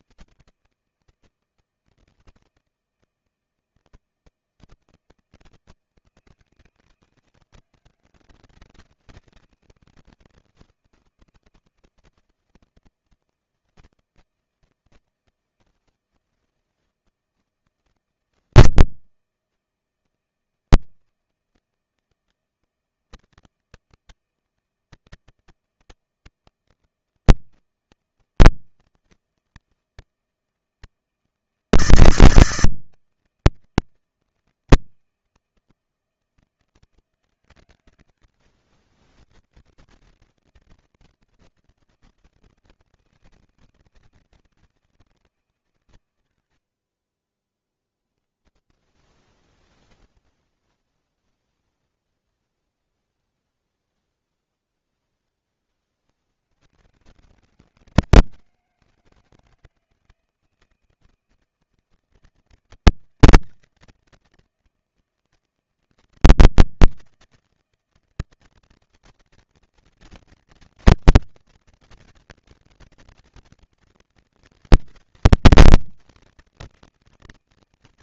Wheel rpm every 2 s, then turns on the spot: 160, 160, 160, 160, 160, 160, 160, 160, 170, 160, 160, 160, 160, 160, 160, 160, 160, 160, 160, 70, 150, 160, 160, 50, 10, 0, 0, 0, 90, 160, 160, 160, 160, 160, 160, 160, 160, 160, 160.
48-50